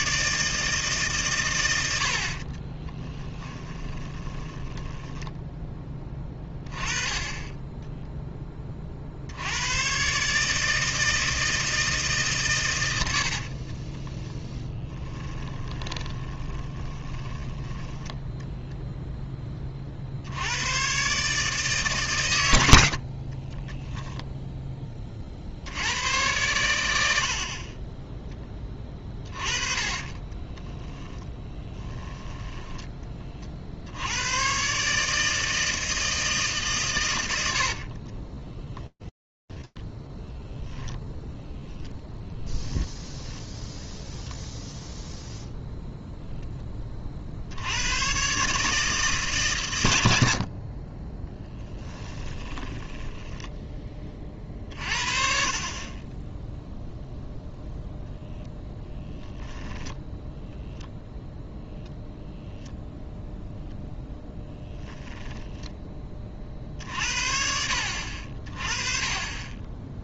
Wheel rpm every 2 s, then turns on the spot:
160, 30, 20, 20, 20, 150, 130, 10, 20, 0, 120, 80, 10, 90, 10, 20, 10, 120, 150, 0, 0, 0, 0, 60, 140, 10, 10, 50, 0, 10, 0, 0, 10, 60, 30.
2-6 14-18 30-34 50-54 64-66